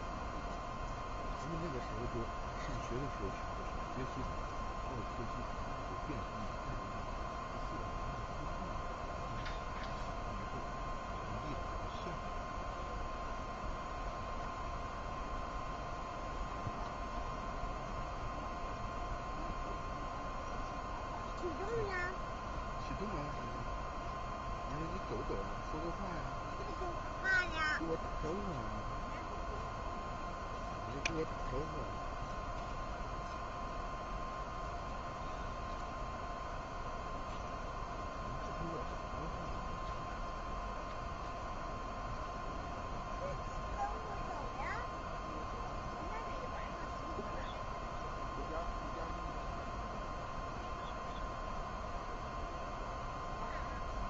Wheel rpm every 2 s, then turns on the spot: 0, 0, 0, 0, 0, 0, 0, 0, 0, 0, 0, 0, 0, 0, 0, 0, 0, 0, 0, 0, 0, 0, 0, 0, 0, 0, 0.
none